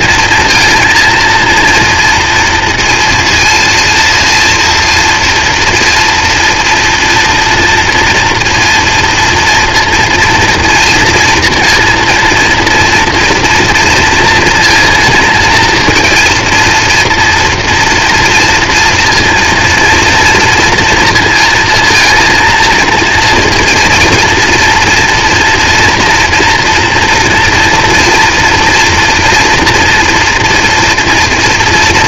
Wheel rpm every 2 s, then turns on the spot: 230, 230, 230, 240, 230, 230, 230, 230, 230, 230, 230, 230, 230, 230, 230, 230.
none